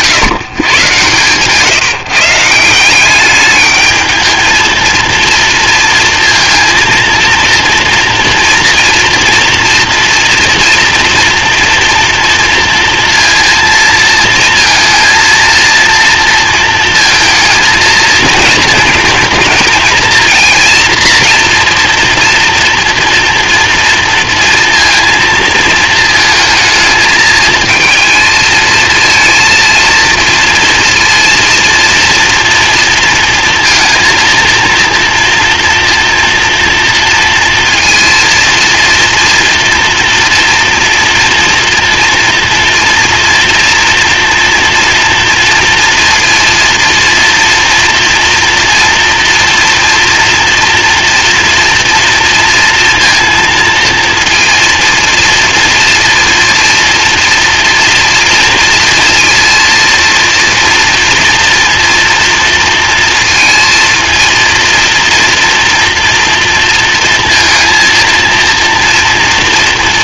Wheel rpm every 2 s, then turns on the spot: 140, 170, 230, 230, 230, 230, 230, 230, 230, 220, 230, 230, 230, 220, 230, 230, 230, 230, 230, 230, 230, 230, 230, 230, 240, 240, 230, 230, 230, 230, 230, 230, 230, 230, 230.
none